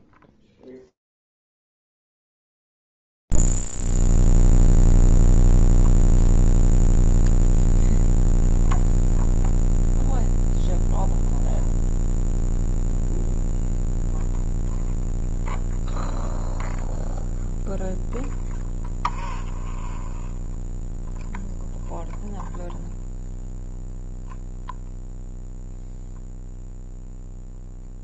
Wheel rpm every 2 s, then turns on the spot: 0, 0, 0, 0, 0, 0, 0, 0, 0, 0, 0, 0, 0, 0.
none